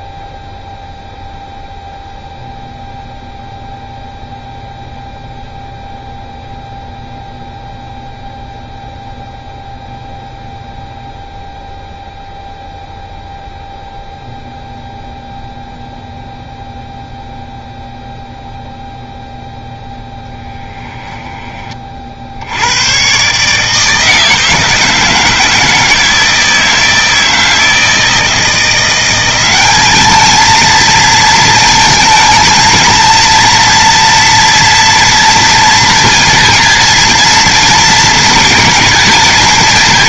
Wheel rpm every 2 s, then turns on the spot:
0, 0, 0, 0, 0, 0, 0, 0, 0, 0, 10, 100, 160, 160, 170, 220, 220, 230, 230, 220.
20-22